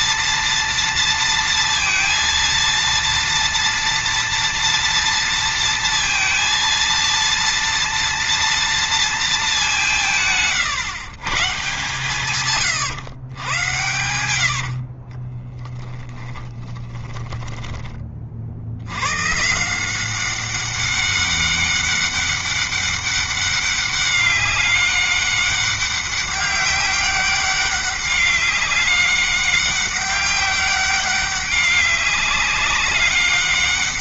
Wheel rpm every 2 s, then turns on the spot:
230, 230, 230, 230, 230, 140, 130, 60, 10, 90, 200, 200, 200, 200, 200, 200, 200.
14-18